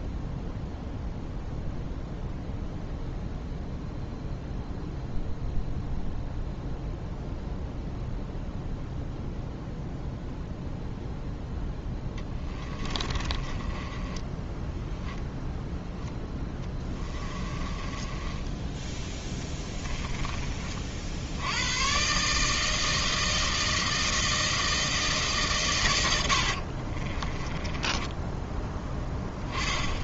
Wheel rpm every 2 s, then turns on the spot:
0, 0, 0, 0, 0, 0, 20, 10, 10, 10, 40, 160, 160, 50, 10.
12-20 26-28